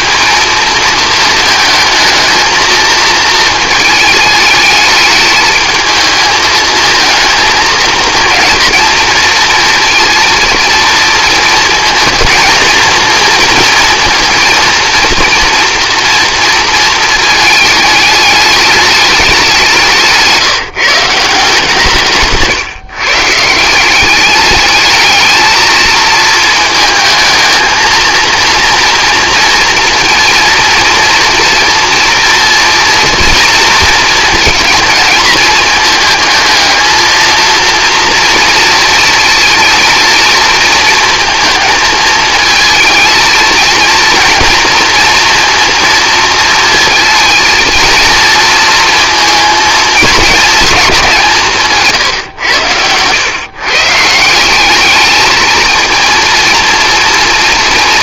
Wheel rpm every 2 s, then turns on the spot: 220, 230, 210, 220, 230, 230, 230, 240, 230, 210, 170, 150, 210, 220, 230, 230, 230, 230, 220, 230, 230, 220, 230, 230, 230, 220, 100, 190, 230.
none